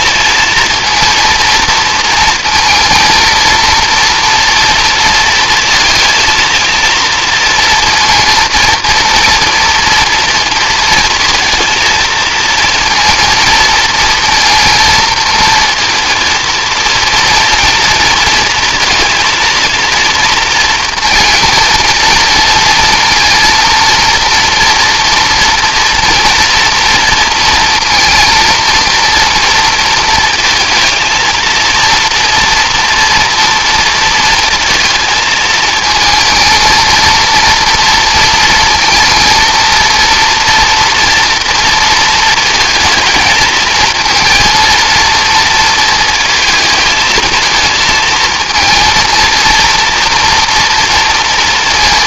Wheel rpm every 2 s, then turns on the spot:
230, 230, 230, 230, 240, 230, 230, 230, 230, 230, 230, 230, 230, 230, 230, 230, 240, 220, 230, 230, 240, 220, 230, 230, 230, 230.
none